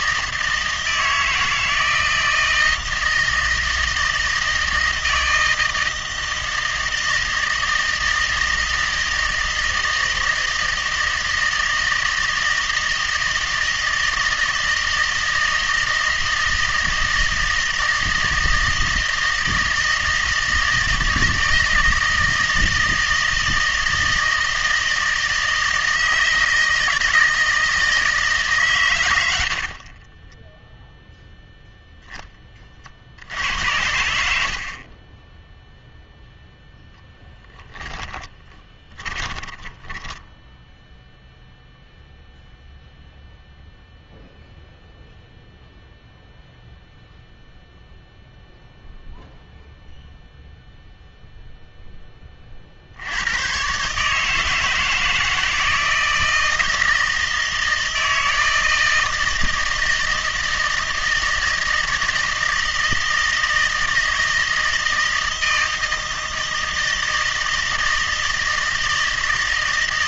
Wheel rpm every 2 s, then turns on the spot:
160, 160, 160, 160, 160, 160, 160, 160, 160, 160, 160, 160, 160, 160, 130, 0, 50, 50, 0, 20, 0, 0, 0, 0, 0, 0, 60, 160, 160, 160, 160, 160, 160, 160, 160.
38-40